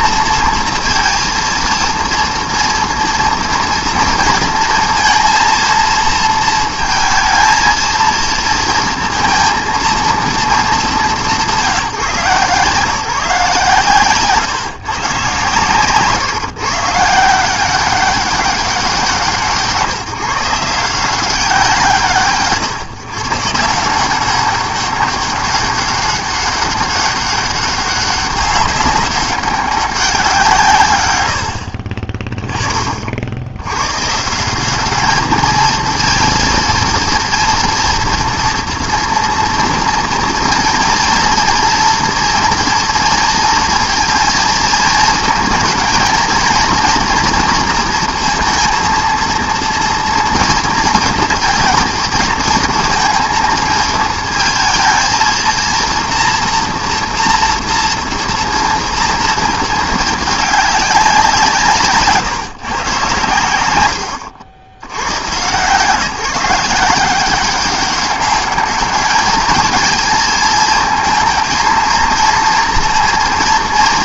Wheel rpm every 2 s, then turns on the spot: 230, 230, 230, 230, 230, 170, 160, 130, 170, 160, 170, 140, 200, 200, 190, 80, 80, 220, 230, 230, 230, 230, 220, 230, 230, 230, 220, 230, 230, 230, 180, 120, 120, 190, 210, 220, 230.
none